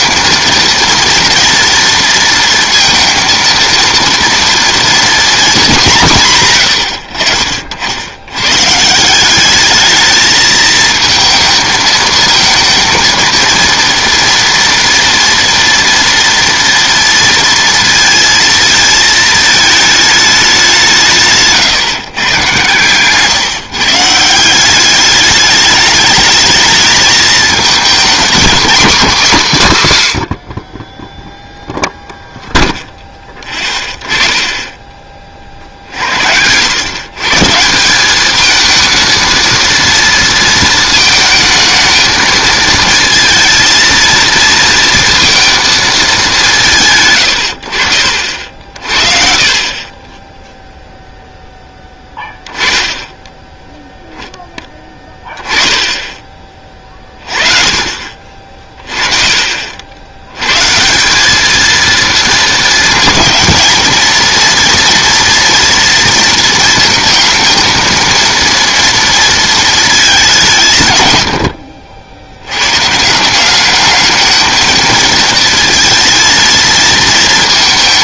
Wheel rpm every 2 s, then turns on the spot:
230, 230, 230, 120, 140, 220, 220, 240, 230, 220, 190, 120, 180, 210, 230, 30, 0, 20, 100, 220, 220, 220, 230, 170, 50, 0, 10, 10, 30, 40, 130, 230, 230, 220, 230, 170, 110, 220, 230.
34-36